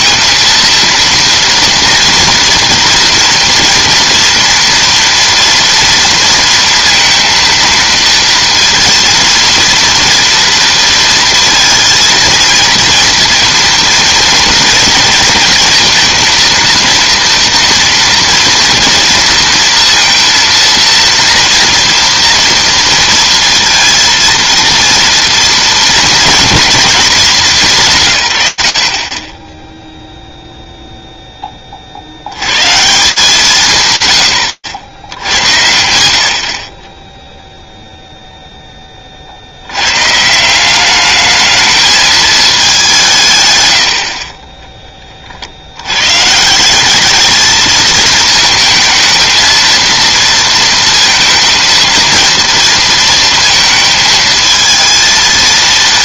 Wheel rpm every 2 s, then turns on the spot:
230, 240, 230, 230, 230, 230, 230, 230, 230, 230, 230, 230, 230, 220, 80, 0, 130, 100, 40, 30, 200, 170, 40, 210, 230, 230, 230, 230.
none